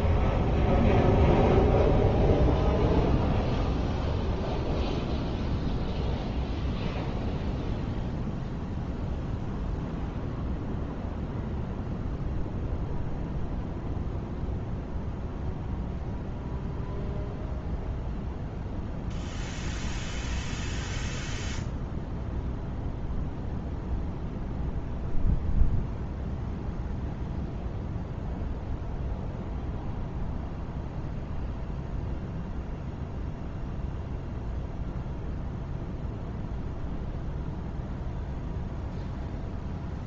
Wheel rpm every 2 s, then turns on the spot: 0, 0, 0, 0, 0, 0, 0, 0, 0, 0, 0, 0, 0, 0, 0, 0, 0, 0, 0, 0.
none